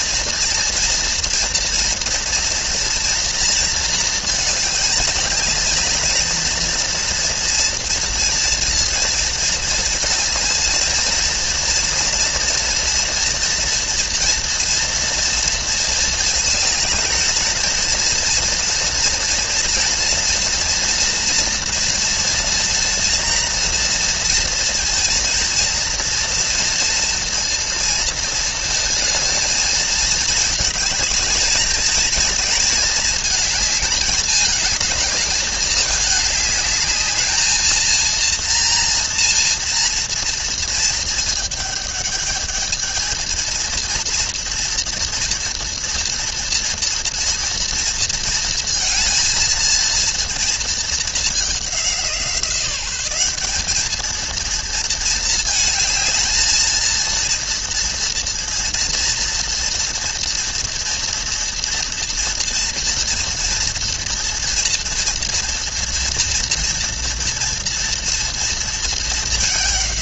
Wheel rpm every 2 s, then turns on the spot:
230, 230, 210, 230, 230, 230, 230, 230, 220, 240, 230, 230, 230, 230, 230, 220, 220, 220, 220, 230, 220, 220, 230, 230, 220, 210, 200, 220, 230, 230, 230, 230, 230, 230, 220.
none